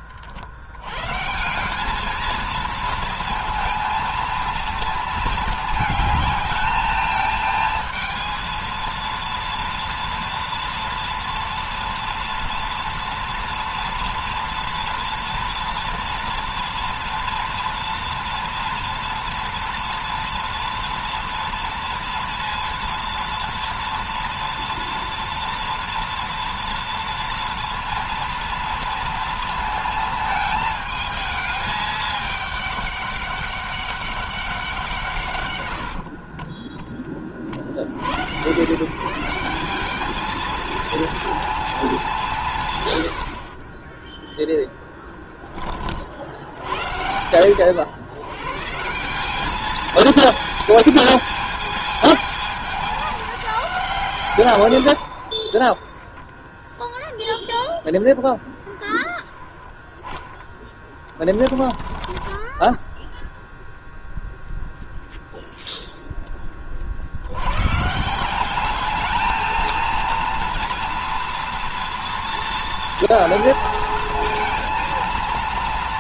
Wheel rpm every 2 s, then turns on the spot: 70, 220, 230, 210, 230, 230, 230, 230, 230, 240, 230, 230, 230, 230, 230, 220, 210, 190, 30, 120, 220, 170, 10, 60, 110, 220, 220, 150, 20, 10, 10, 20, 0, 20, 180, 230, 230, 230.
62-64